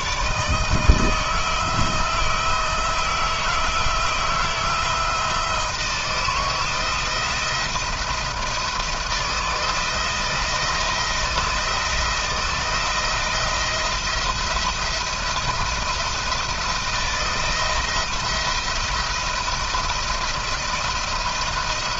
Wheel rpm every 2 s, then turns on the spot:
150, 160, 160, 160, 170, 170, 160, 170, 170, 170, 170.
none